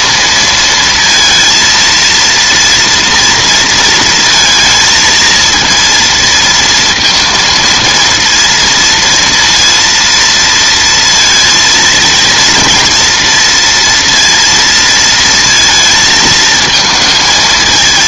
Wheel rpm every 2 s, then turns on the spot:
230, 230, 230, 230, 230, 230, 230, 230, 220.
none